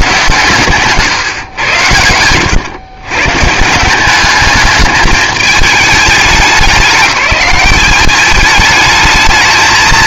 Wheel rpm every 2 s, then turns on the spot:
130, 110, 210, 200, 210.
none